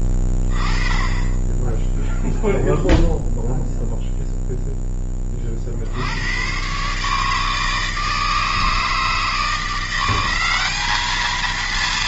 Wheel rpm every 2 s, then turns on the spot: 20, 0, 0, 120, 160, 200.
none